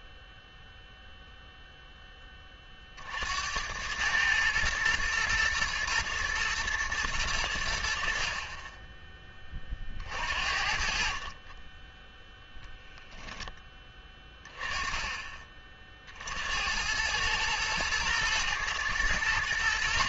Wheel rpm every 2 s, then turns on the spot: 0, 40, 110, 110, 30, 50, 0, 20, 80, 110.
none